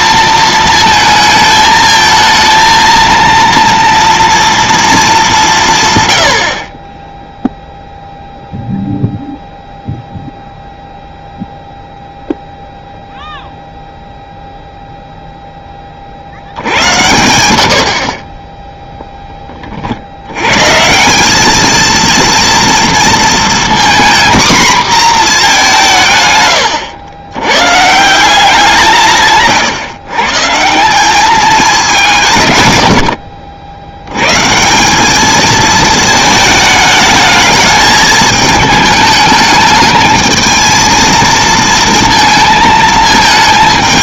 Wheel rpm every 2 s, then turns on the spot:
230, 230, 230, 30, 0, 0, 0, 0, 90, 10, 130, 230, 240, 100, 160, 170, 110, 170, 220, 220, 220, 220.
none